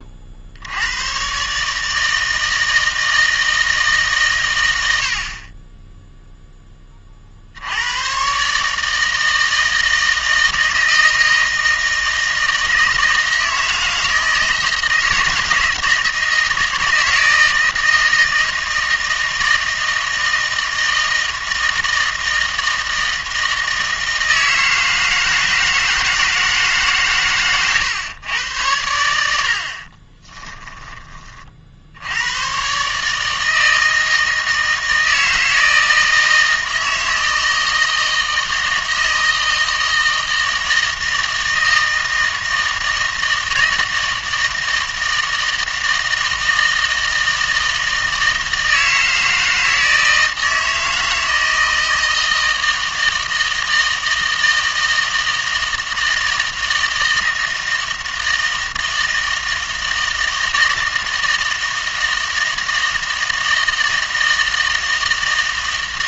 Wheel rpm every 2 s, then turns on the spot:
80, 160, 90, 10, 150, 160, 160, 160, 160, 160, 160, 160, 160, 150, 100, 20, 120, 160, 160, 160, 160, 160, 160, 160, 160, 160, 160, 160, 160, 160, 160, 160, 160.
30-32